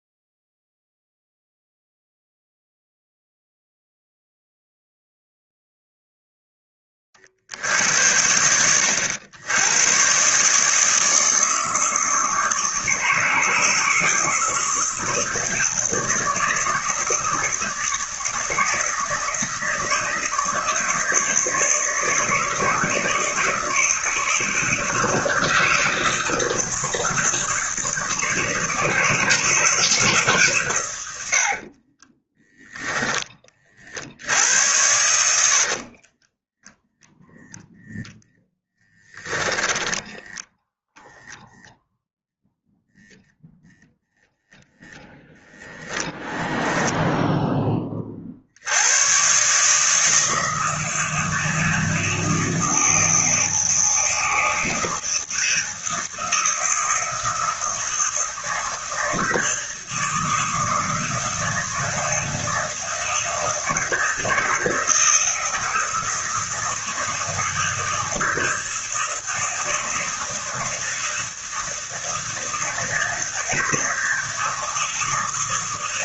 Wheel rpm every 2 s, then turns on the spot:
0, 0, 0, 20, 90, 150, 160, 160, 160, 160, 160, 160, 160, 160, 160, 110, 10, 90, 10, 10, 0, 0, 0, 0, 90, 160, 160, 160, 160, 160, 160, 160, 160, 160, 160, 160, 160, 160.
34-40